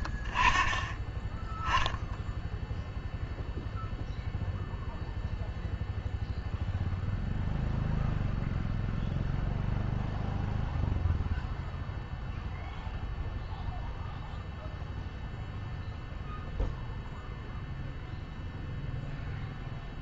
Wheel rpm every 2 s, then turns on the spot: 40, 0, 0, 0, 0, 0, 0, 0, 0, 0.
none